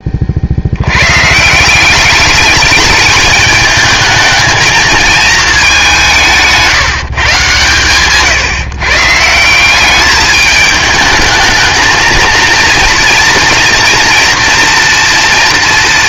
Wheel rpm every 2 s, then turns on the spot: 130, 210, 220, 150, 150, 220, 230, 190.
none